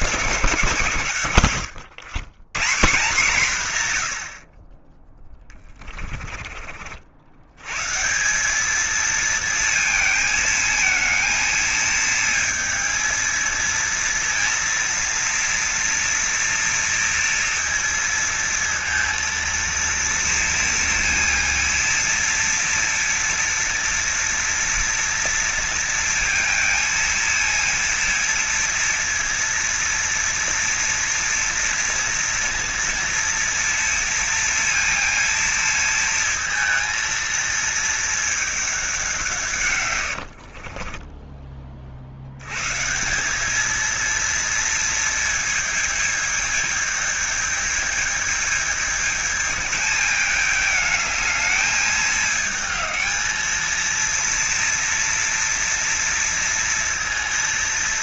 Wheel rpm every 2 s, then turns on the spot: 140, 150, 20, 50, 220, 220, 230, 230, 230, 230, 230, 230, 240, 230, 230, 230, 230, 230, 220, 190, 30, 140, 230, 220, 220, 210, 220, 230, 230.
40-42